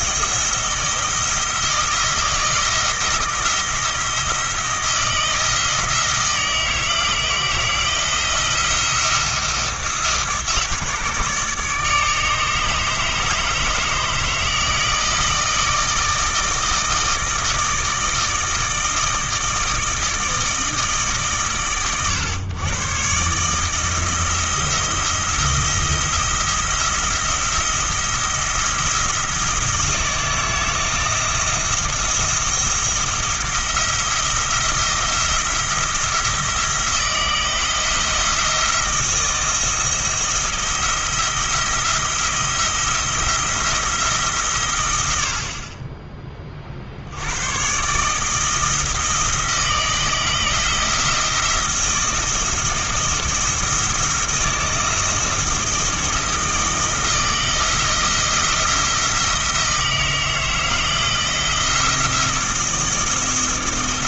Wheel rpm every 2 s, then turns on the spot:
170, 160, 170, 160, 170, 150, 150, 160, 160, 160, 160, 120, 170, 170, 170, 160, 170, 170, 170, 170, 170, 170, 120, 40, 160, 170, 170, 170, 160, 160, 160, 160.
none